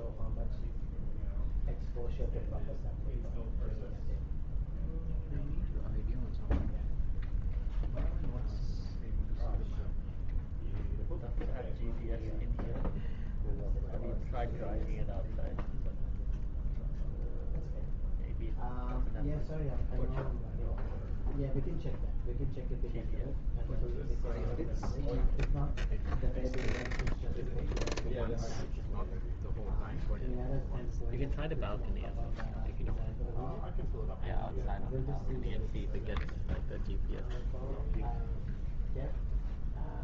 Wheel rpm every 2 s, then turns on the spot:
0, 0, 0, 0, 0, 0, 0, 0, 0, 0, 0, 0, 0, 0, 0, 0, 0, 0, 0, 0.
none